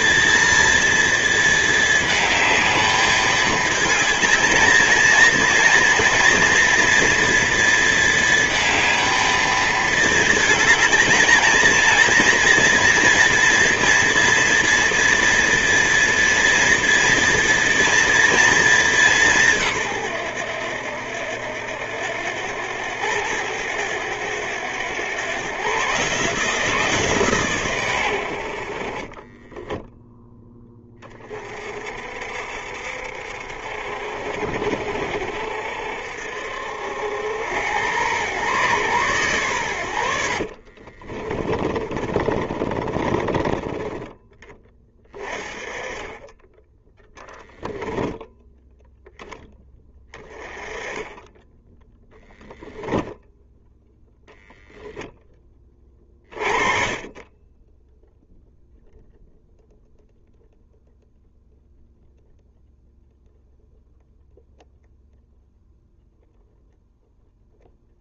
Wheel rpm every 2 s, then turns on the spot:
230, 210, 230, 230, 220, 220, 240, 230, 230, 200, 80, 100, 100, 160, 40, 10, 60, 60, 70, 120, 60, 30, 20, 10, 0, 20, 10, 0, 30, 0, 0, 0, 0, 0.
40-44 52-54